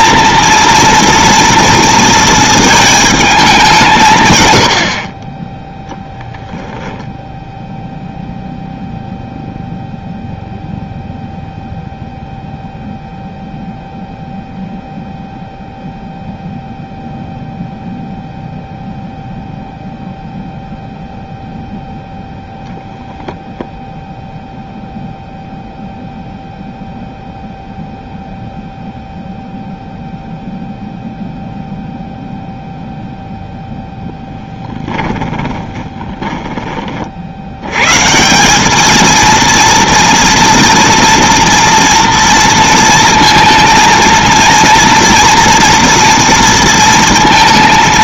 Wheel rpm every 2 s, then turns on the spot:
230, 220, 110, 0, 0, 0, 0, 0, 0, 0, 0, 0, 0, 0, 0, 0, 0, 10, 20, 200, 230, 230, 230, 230.
34-36